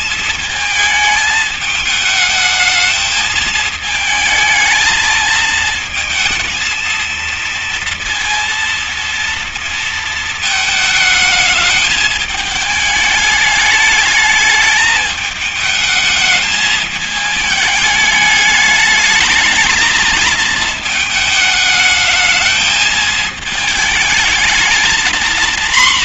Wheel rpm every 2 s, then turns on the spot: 220, 210, 220, 220, 230, 220, 220, 210, 220, 210, 220, 220, 220.
none